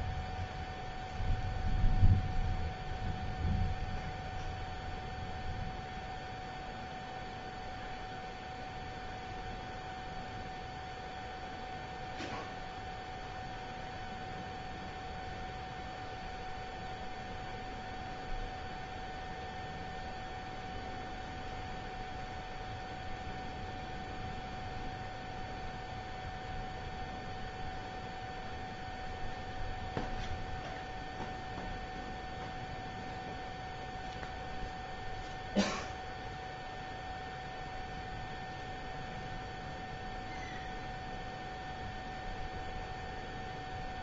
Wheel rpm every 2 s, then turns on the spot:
0, 0, 0, 0, 0, 0, 0, 0, 0, 0, 0, 0, 0, 0, 0, 0, 0, 0, 0, 0, 0, 0.
none